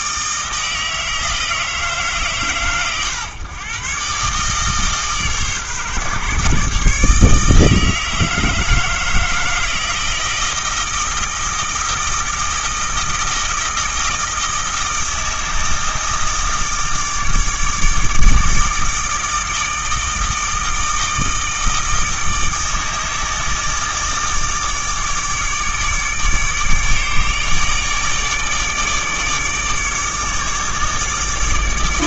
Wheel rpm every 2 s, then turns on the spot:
160, 120, 150, 150, 160, 160, 160, 160, 160, 160, 160, 160, 150, 150, 150, 150.
none